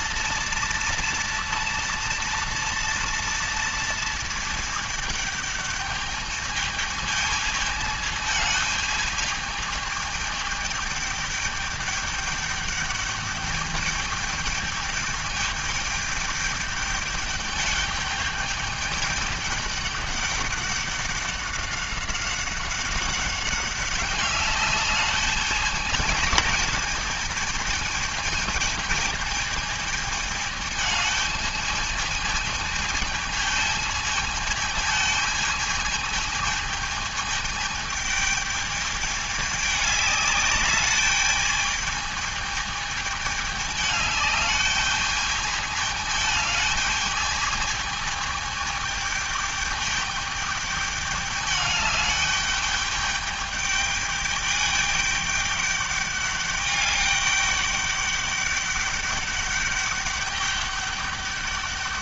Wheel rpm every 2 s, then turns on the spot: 230, 230, 220, 210, 220, 210, 210, 210, 210, 210, 200, 190, 200, 210, 220, 220, 220, 220, 220, 210, 200, 220, 210, 220, 210, 210, 210, 210, 200, 200, 200.
none